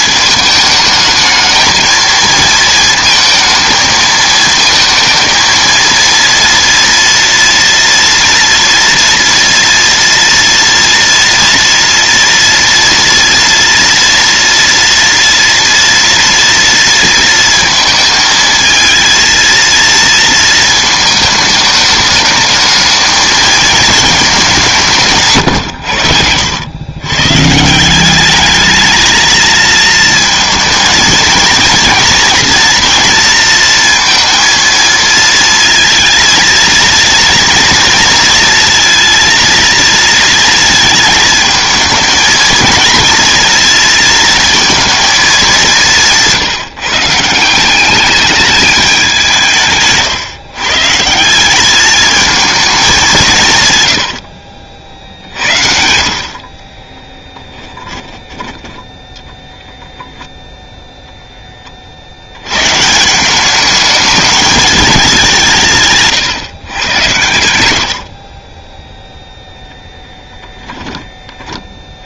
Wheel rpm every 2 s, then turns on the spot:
220, 230, 220, 230, 230, 230, 230, 240, 230, 220, 220, 210, 190, 100, 210, 230, 230, 230, 230, 230, 220, 230, 230, 170, 210, 140, 220, 50, 40, 10, 0, 120, 210, 120, 20, 10.
54-58 68-72